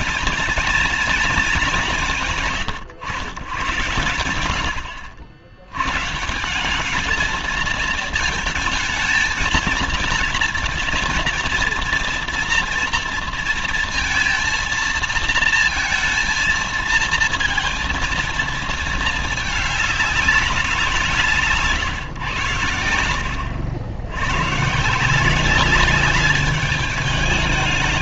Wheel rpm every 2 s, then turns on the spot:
230, 140, 90, 170, 220, 230, 240, 230, 230, 230, 190, 130, 120, 210.
none